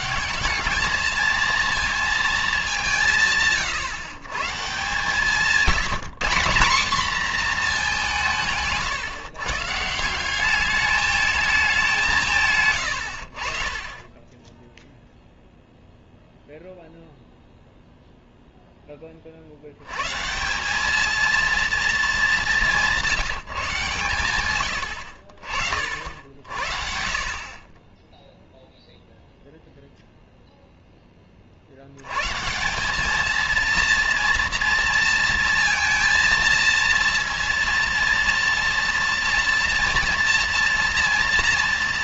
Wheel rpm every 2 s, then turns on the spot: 220, 170, 160, 220, 140, 210, 70, 0, 0, 20, 210, 180, 90, 60, 0, 0, 170, 240, 230, 230, 230.
none